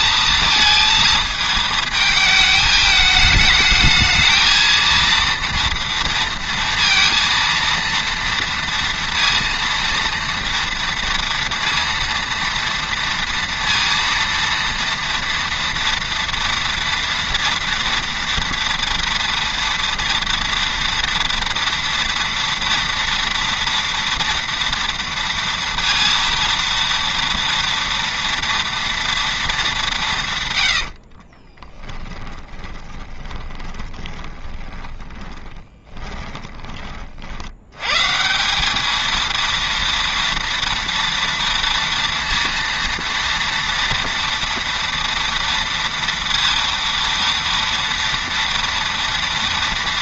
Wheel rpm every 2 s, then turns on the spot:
230, 220, 220, 230, 230, 230, 230, 230, 240, 230, 240, 230, 240, 230, 230, 110, 20, 20, 20, 190, 230, 230, 230, 230, 230.
30-36